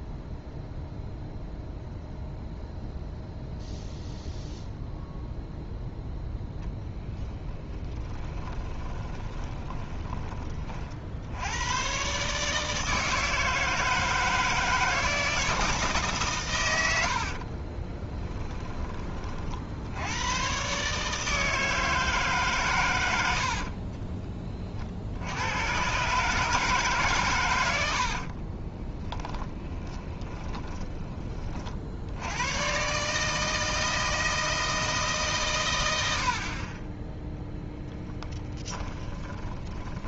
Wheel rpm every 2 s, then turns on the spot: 0, 0, 0, 10, 20, 50, 150, 160, 100, 20, 130, 120, 40, 150, 20, 10, 130, 160, 30, 20.
6-10 28-30 38-40